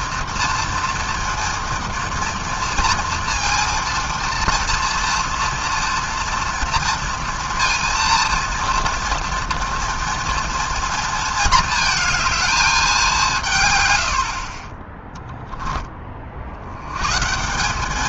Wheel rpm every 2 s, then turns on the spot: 230, 230, 230, 230, 230, 230, 210, 20, 90.
none